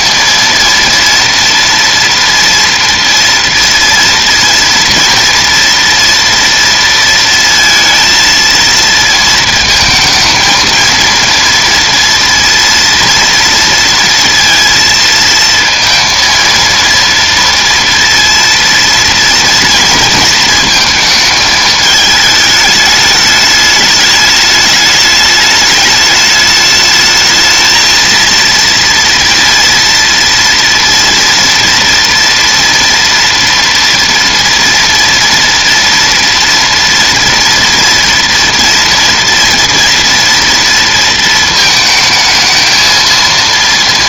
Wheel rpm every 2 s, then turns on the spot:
230, 230, 240, 230, 230, 230, 230, 230, 230, 230, 230, 210, 210, 210, 230, 230, 230, 230, 230, 230, 230, 220.
none